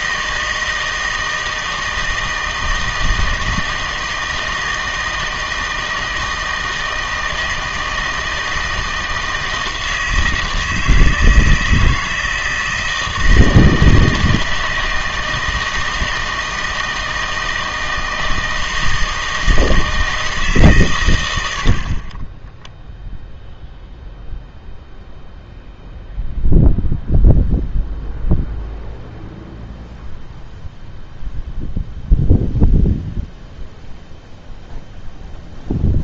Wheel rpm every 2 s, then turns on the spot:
160, 160, 160, 160, 160, 160, 160, 160, 160, 160, 140, 10, 0, 0, 0, 0, 0, 0.
22-24